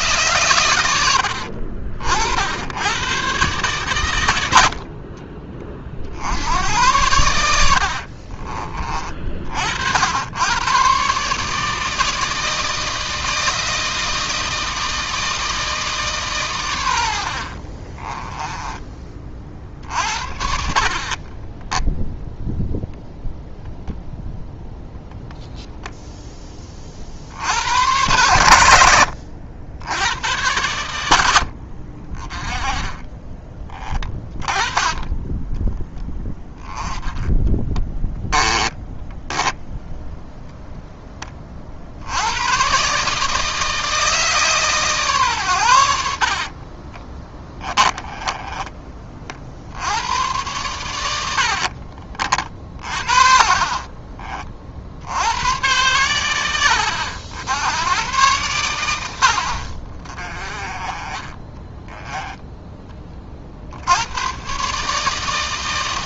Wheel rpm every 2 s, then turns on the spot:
110, 80, 70, 90, 40, 120, 160, 160, 110, 20, 50, 0, 0, 20, 100, 100, 20, 20, 10, 10, 10, 120, 150, 40, 20, 110, 40, 50, 90, 100, 30, 20, 150.
8-10 18-20 36-40 46-50 52-54